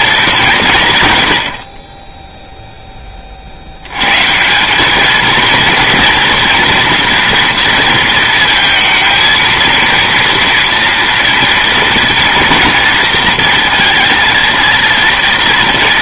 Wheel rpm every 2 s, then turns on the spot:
170, 0, 190, 230, 220, 230, 230, 230.
none